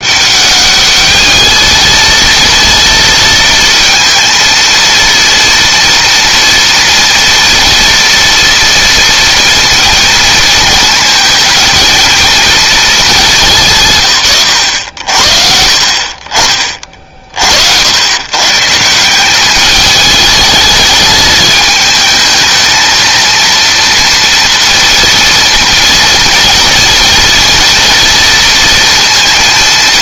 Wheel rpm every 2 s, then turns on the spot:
200, 230, 230, 230, 230, 230, 220, 90, 30, 150, 220, 220, 230, 230, 230.
none